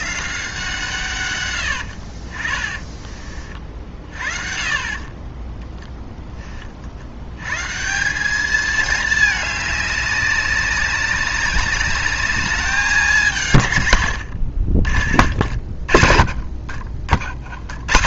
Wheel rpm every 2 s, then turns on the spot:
160, 30, 30, 50, 210, 200, 210, 70, 60.
14-16